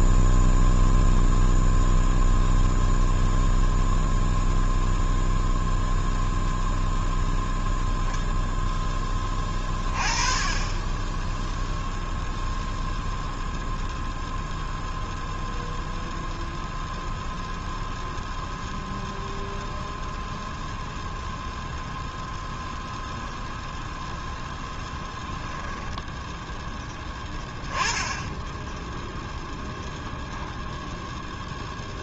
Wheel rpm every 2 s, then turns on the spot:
0, 0, 0, 0, 10, 20, 0, 0, 0, 0, 0, 0, 0, 10, 10, 0.
none